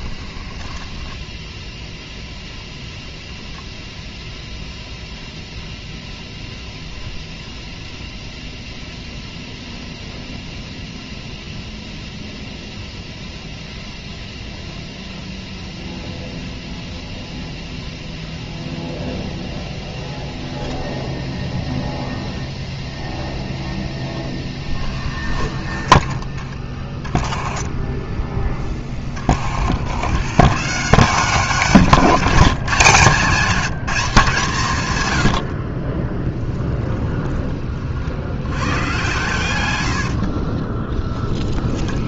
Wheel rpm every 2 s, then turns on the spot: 10, 10, 0, 0, 0, 0, 0, 0, 0, 0, 0, 10, 30, 20, 20, 160, 170, 140, 10, 110, 10.
0-2 36-38 40-42